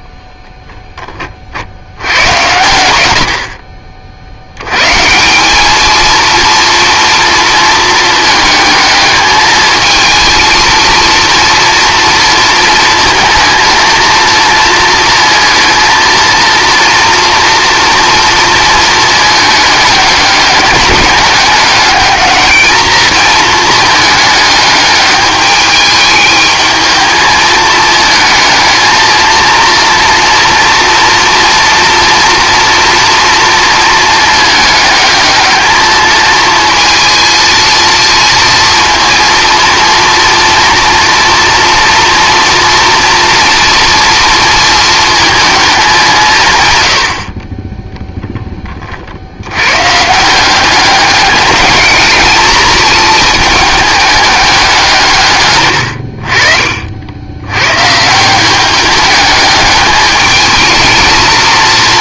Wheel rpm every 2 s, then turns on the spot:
0, 100, 110, 230, 220, 230, 220, 230, 230, 220, 200, 220, 210, 220, 220, 230, 230, 220, 230, 230, 240, 230, 230, 110, 20, 190, 220, 200, 60, 190, 220.
none